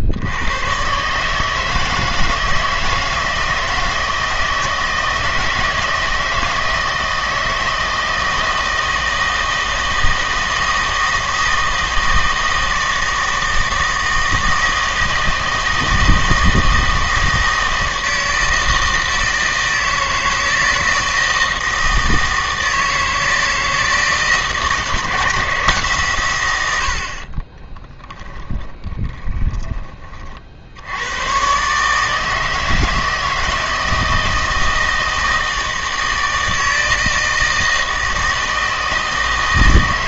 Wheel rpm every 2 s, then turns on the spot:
120, 160, 160, 160, 160, 160, 160, 160, 160, 160, 160, 160, 160, 100, 30, 60, 160, 160, 160, 160.
26-30